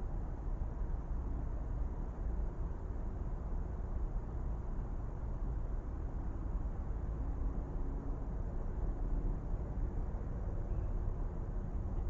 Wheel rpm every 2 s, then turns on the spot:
0, 0, 0, 0, 0, 0.
none